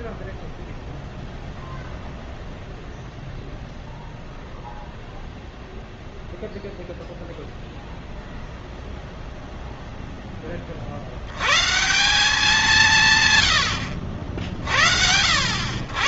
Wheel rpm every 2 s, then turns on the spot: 0, 0, 0, 0, 0, 60, 170, 60.
none